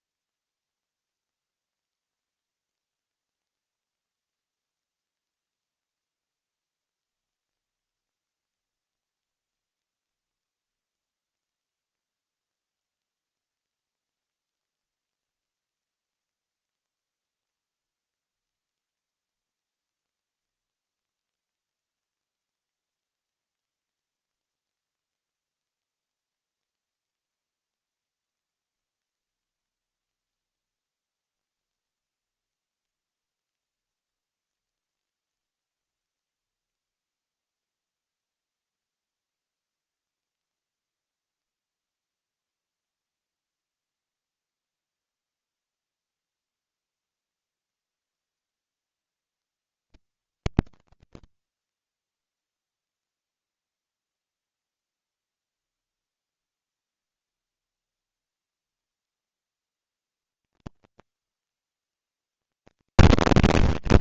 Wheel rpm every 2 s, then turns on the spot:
0, 0, 0, 0, 0, 0, 0, 0, 0, 0, 0, 0, 0, 0, 0, 0, 0, 0, 0, 0, 0, 0, 0, 0, 0, 0, 0, 0, 0, 140, 230, 230.
none